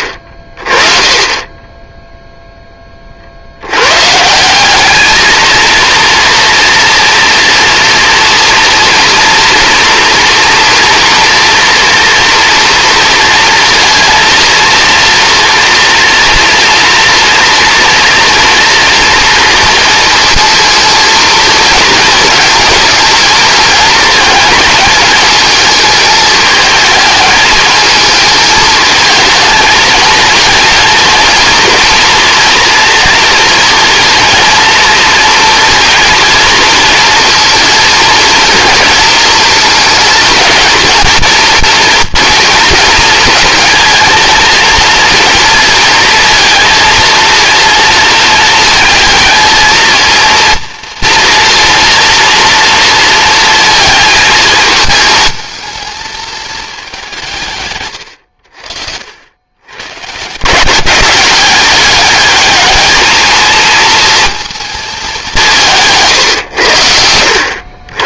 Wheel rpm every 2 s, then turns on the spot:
30, 20, 200, 240, 240, 230, 230, 230, 230, 230, 230, 220, 220, 220, 220, 230, 230, 230, 230, 230, 220, 230, 230, 230, 220, 230, 230, 220, 200, 70, 190, 220, 220, 90.
none